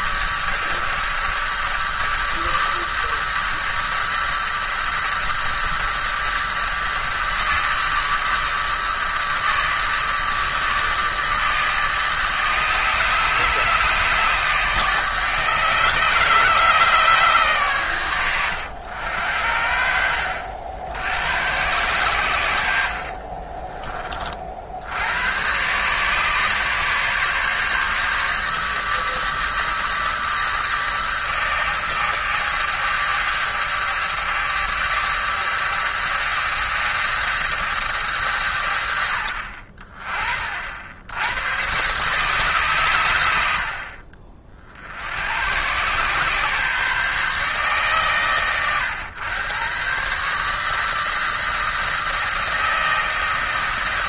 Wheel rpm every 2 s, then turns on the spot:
150, 150, 150, 150, 150, 150, 150, 150, 150, 100, 70, 70, 60, 140, 150, 160, 160, 160, 160, 110, 50, 120, 50, 140, 120, 150, 160.
22-24